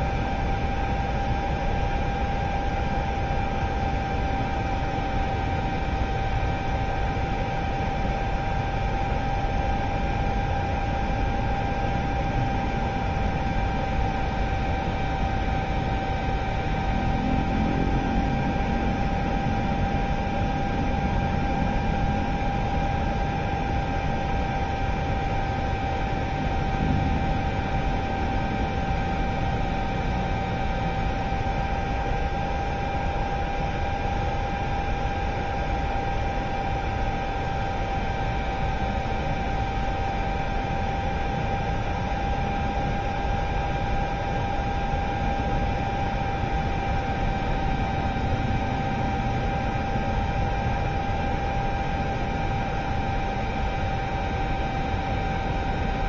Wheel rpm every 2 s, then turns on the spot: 0, 0, 0, 0, 0, 0, 0, 0, 0, 0, 0, 0, 0, 0, 0, 0, 0, 0, 0, 0, 0, 0, 0, 0, 0, 0, 0, 0.
none